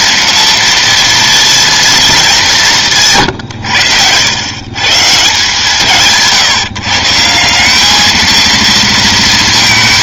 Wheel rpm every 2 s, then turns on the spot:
230, 170, 120, 150, 230.
none